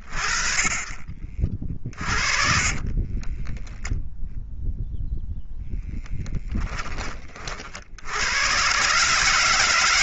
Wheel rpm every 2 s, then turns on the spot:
30, 10, 20, 90, 160.
0-6